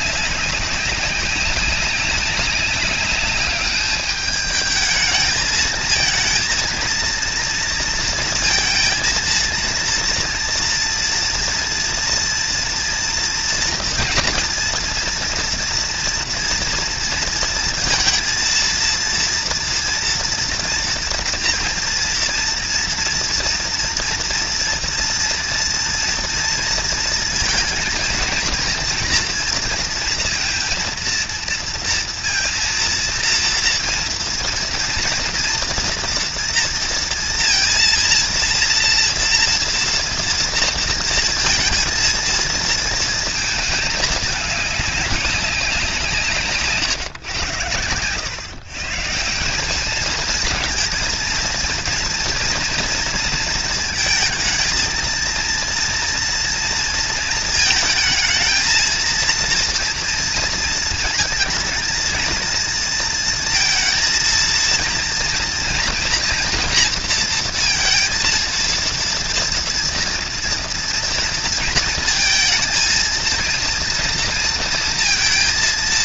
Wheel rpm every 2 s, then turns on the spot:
200, 200, 210, 220, 230, 230, 230, 230, 230, 230, 230, 230, 230, 230, 230, 230, 230, 230, 230, 230, 230, 230, 210, 150, 120, 220, 230, 220, 230, 220, 230, 230, 230, 230, 230, 230, 220, 230.
none